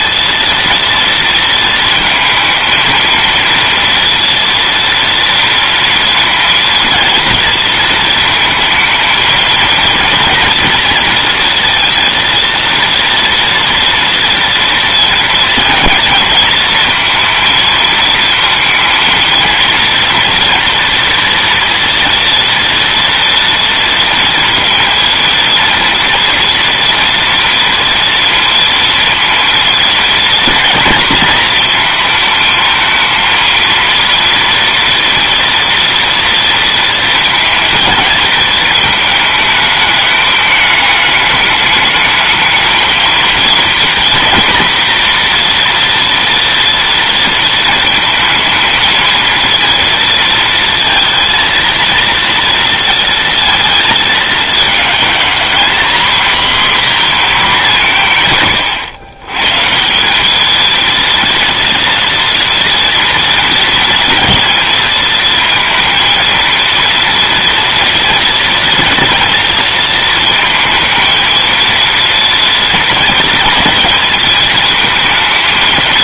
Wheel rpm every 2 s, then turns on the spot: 230, 220, 230, 230, 220, 230, 230, 230, 220, 230, 230, 240, 230, 230, 230, 230, 220, 230, 230, 220, 210, 220, 230, 230, 220, 230, 230, 220, 250, 90, 220, 230, 230, 230, 230, 220, 230, 220.
none